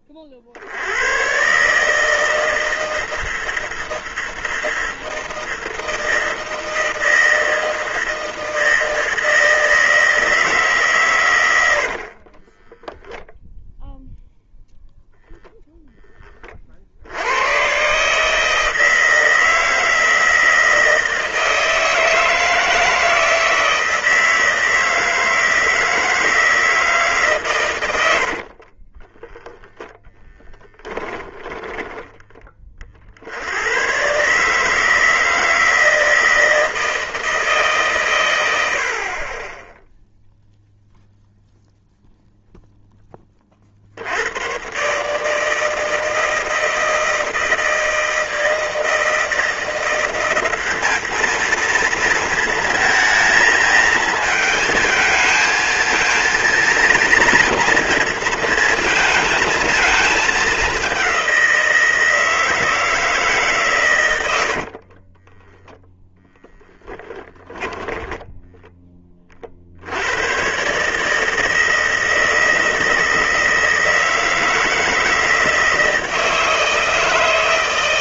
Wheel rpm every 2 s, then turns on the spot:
70, 160, 160, 160, 160, 150, 20, 0, 40, 160, 160, 160, 160, 160, 50, 10, 30, 150, 160, 80, 0, 0, 120, 160, 160, 200, 220, 220, 230, 230, 210, 160, 60, 10, 10, 130, 160, 160, 160.
12-14 28-30 64-66